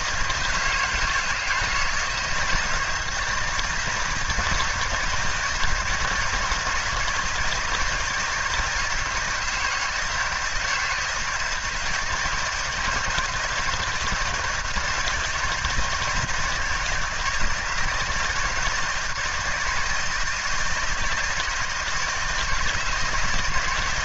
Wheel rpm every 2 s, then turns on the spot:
160, 160, 160, 170, 160, 160, 160, 160, 160, 160, 160, 160.
none